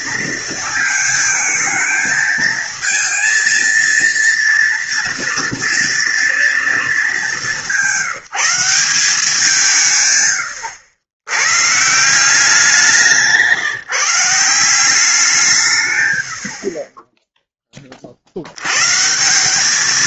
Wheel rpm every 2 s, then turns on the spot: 230, 220, 230, 230, 180, 100, 180, 170, 70, 80.
none